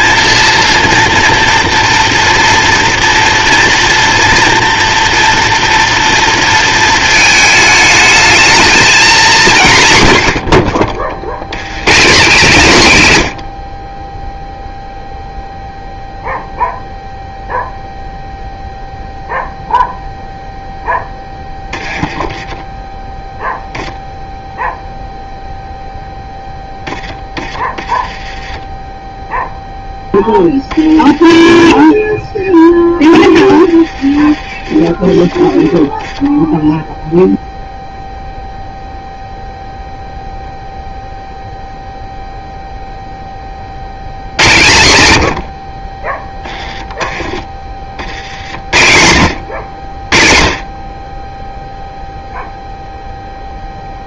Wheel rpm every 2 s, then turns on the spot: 230, 240, 240, 230, 230, 70, 160, 0, 0, 0, 0, 20, 0, 10, 10, 10, 10, 30, 0, 0, 0, 0, 110, 10, 50, 30, 0.
22-24 44-46